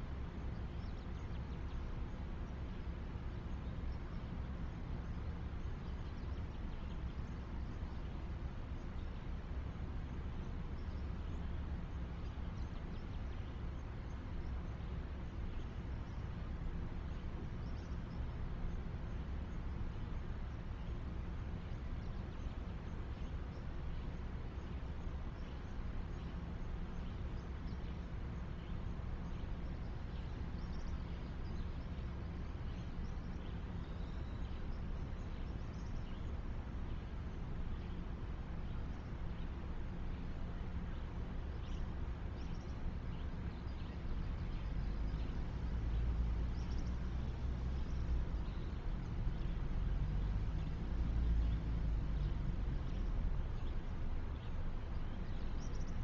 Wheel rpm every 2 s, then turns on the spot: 0, 0, 0, 0, 0, 0, 0, 0, 0, 0, 0, 0, 0, 0, 0, 0, 0, 0, 0, 0, 0, 0, 0, 0, 0, 0, 0, 0.
none